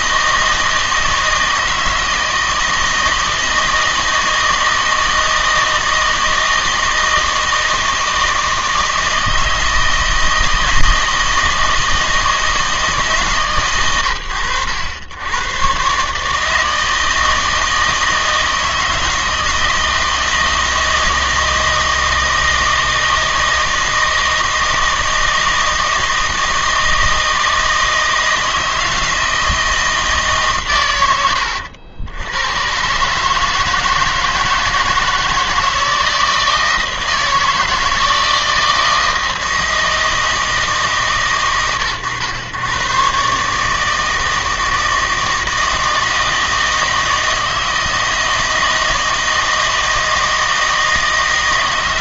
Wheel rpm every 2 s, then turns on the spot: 160, 160, 160, 160, 160, 160, 160, 90, 160, 160, 160, 160, 160, 160, 160, 120, 130, 160, 160, 160, 150, 120, 160, 160, 160, 160.
none